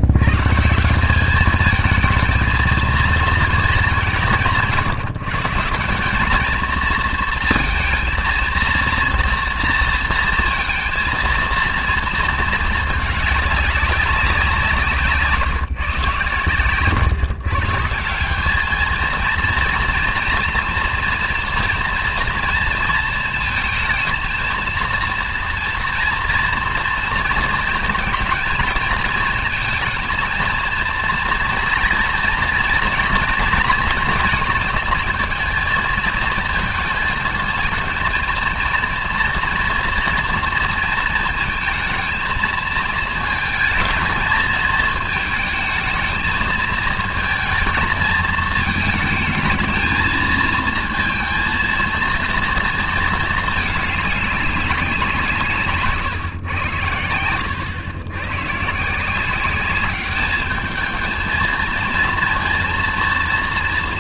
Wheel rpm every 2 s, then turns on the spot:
160, 220, 160, 220, 230, 230, 210, 170, 140, 210, 230, 230, 230, 230, 220, 230, 230, 220, 220, 230, 230, 220, 220, 220, 220, 230, 220, 190, 100, 150, 220, 230.
16-18